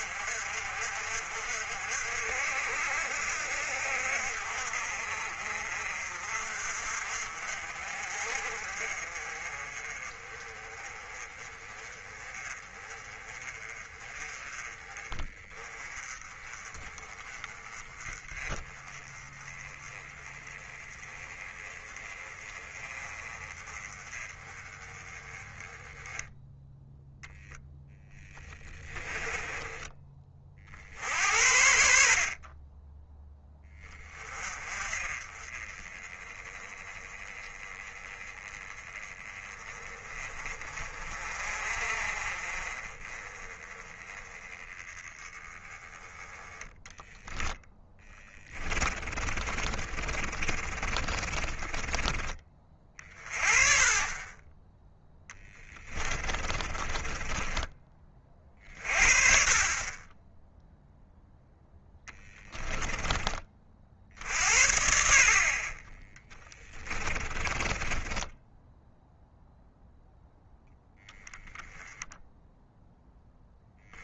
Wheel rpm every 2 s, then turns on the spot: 50, 60, 50, 50, 40, 30, 30, 20, 20, 20, 20, 20, 20, 0, 20, 50, 20, 30, 20, 20, 40, 30, 20, 10, 20, 30, 30, 20, 30, 40, 0, 10, 50, 20, 0, 0, 0.
28-30 48-52 56-58 62-64 66-68